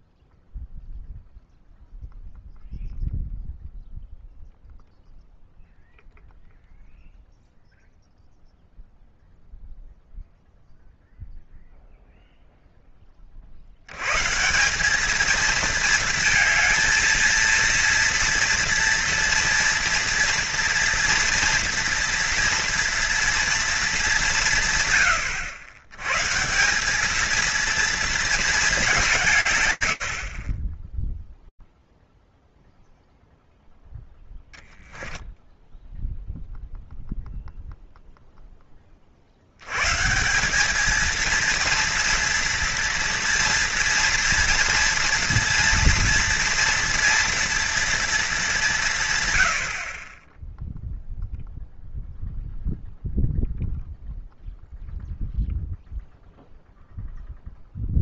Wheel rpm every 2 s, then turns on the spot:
0, 0, 0, 0, 0, 0, 30, 210, 230, 230, 230, 230, 100, 220, 180, 0, 0, 10, 0, 70, 230, 230, 240, 240, 100, 0, 0, 0, 0.
none